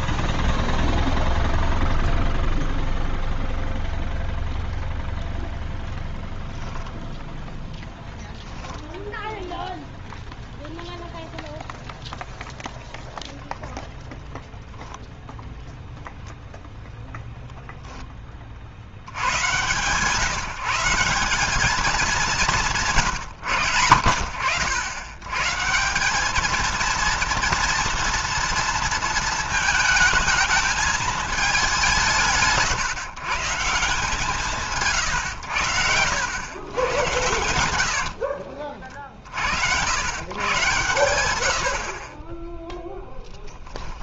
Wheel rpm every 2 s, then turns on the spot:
0, 0, 0, 0, 0, 0, 0, 10, 0, 40, 150, 170, 80, 220, 230, 220, 150, 150, 90, 50, 110, 10.
38-40 42-44